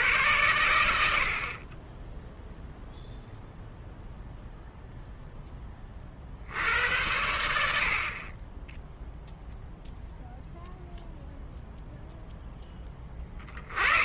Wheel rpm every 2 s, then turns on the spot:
90, 0, 0, 80, 10, 0, 20.
none